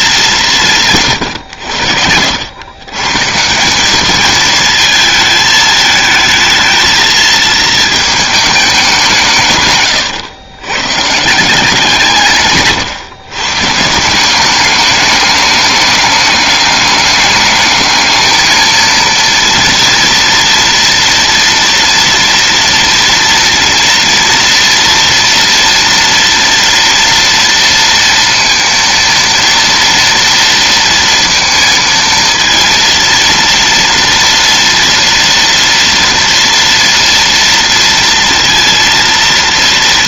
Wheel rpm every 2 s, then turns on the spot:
150, 130, 220, 220, 180, 150, 130, 210, 210, 230, 230, 230, 230, 230, 230, 230, 230, 230, 230, 230.
none